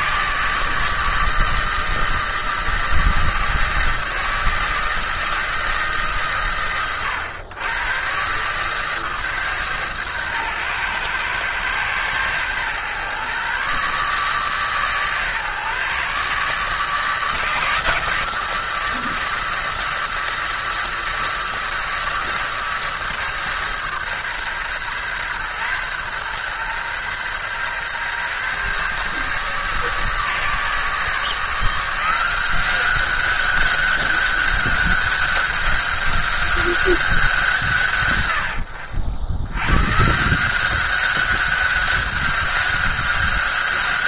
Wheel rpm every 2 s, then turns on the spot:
150, 160, 160, 110, 140, 120, 120, 140, 150, 160, 150, 150, 130, 130, 140, 150, 180, 190, 190, 90, 180, 190.
none